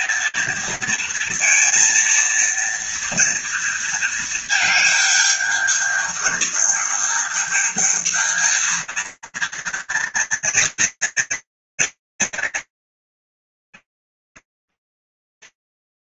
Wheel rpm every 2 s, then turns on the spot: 230, 230, 230, 210, 220, 230, 210, 140.
14-16